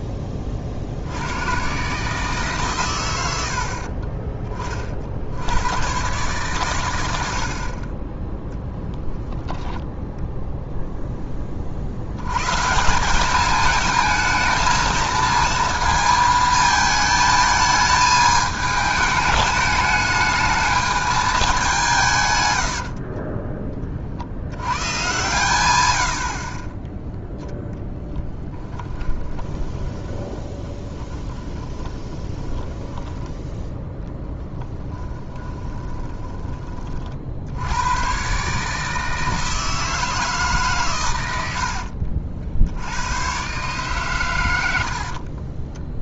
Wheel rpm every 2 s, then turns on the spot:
60, 130, 40, 110, 20, 0, 160, 220, 220, 210, 220, 80, 110, 20, 10, 30, 20, 10, 30, 150, 130, 80, 80.
8-10 22-24 28-36